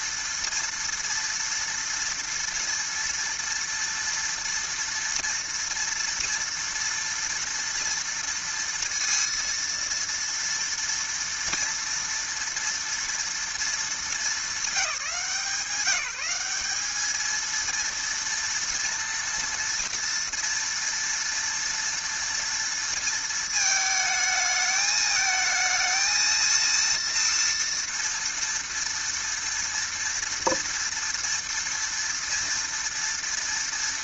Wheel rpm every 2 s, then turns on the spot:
230, 230, 230, 230, 230, 230, 230, 200, 210, 230, 230, 230, 220, 230, 230, 230, 230.
none